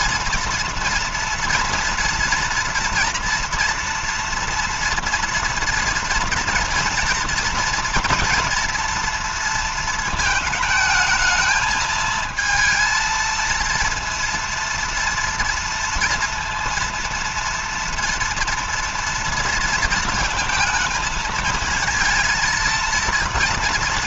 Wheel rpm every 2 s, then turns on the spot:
230, 230, 230, 230, 240, 220, 220, 230, 230, 230, 230, 230.
none